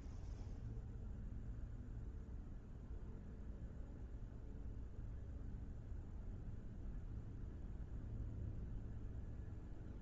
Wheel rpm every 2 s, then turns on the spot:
0, 0, 0, 0, 0.
none